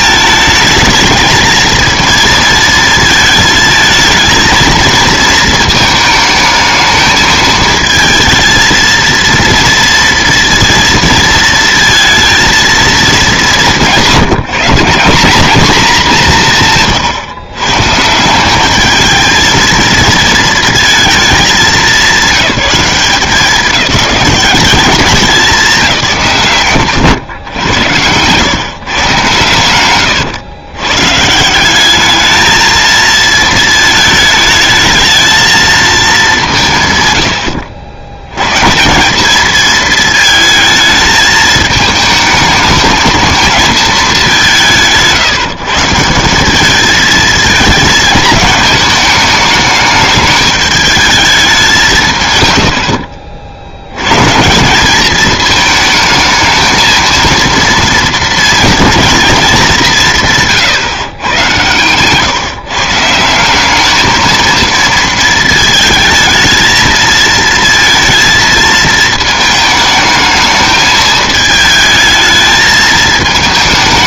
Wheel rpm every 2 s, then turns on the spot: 220, 230, 230, 220, 230, 230, 220, 180, 150, 200, 230, 190, 200, 130, 140, 110, 220, 220, 160, 150, 220, 220, 180, 210, 220, 210, 90, 180, 220, 230, 130, 160, 230, 220, 220, 220, 220.
none